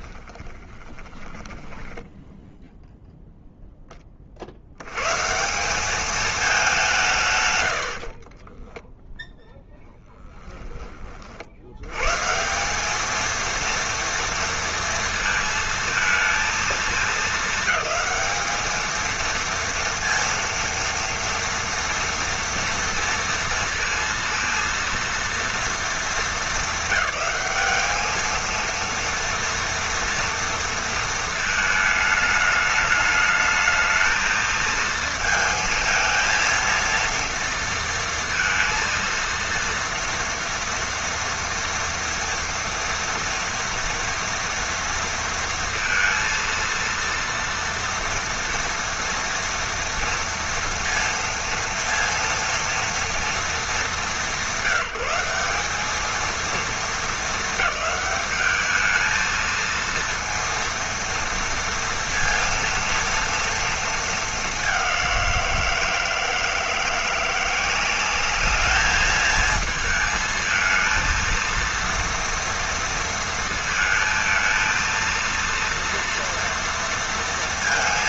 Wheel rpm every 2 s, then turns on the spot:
10, 10, 200, 100, 0, 110, 230, 220, 220, 230, 230, 230, 220, 200, 230, 220, 220, 230, 230, 230, 240, 230, 230, 230, 230, 230, 230, 190, 220, 220, 230, 230, 180, 170, 220, 230, 230, 230, 230.
0-2 6-8